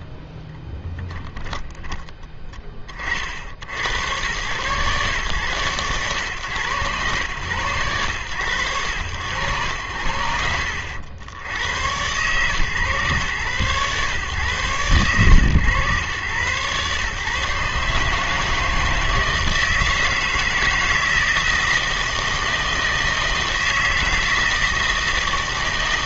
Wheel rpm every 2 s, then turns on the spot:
0, 30, 120, 110, 90, 70, 120, 110, 130, 160, 160, 160, 160.
none